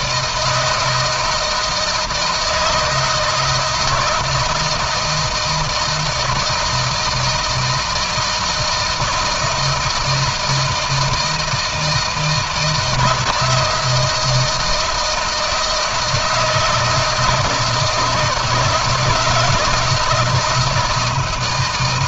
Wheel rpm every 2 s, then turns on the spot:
160, 160, 160, 160, 160, 160, 170, 160, 160, 160, 160.
none